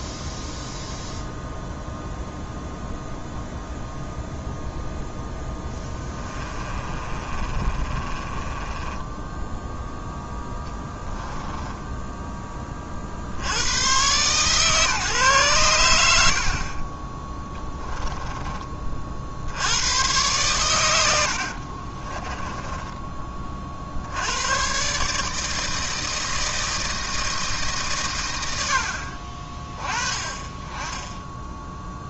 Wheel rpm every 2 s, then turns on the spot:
0, 0, 0, 20, 20, 10, 30, 150, 40, 30, 110, 10, 120, 160, 80, 20.
6-12 22-24